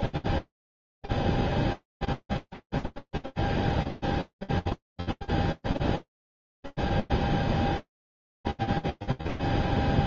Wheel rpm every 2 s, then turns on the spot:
0, 0, 0, 0, 30.
none